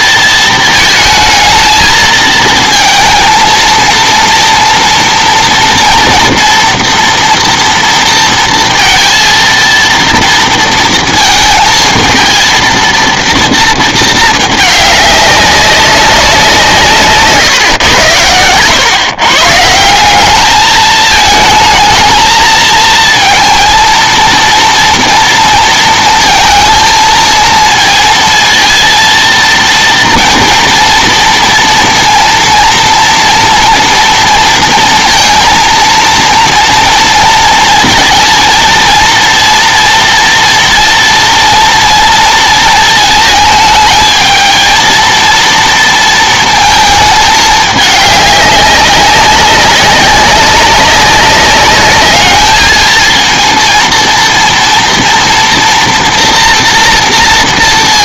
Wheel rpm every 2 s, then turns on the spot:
220, 220, 230, 230, 230, 230, 220, 210, 170, 110, 210, 220, 230, 230, 230, 230, 230, 230, 230, 230, 230, 230, 220, 230, 200, 190, 220, 230, 230.
none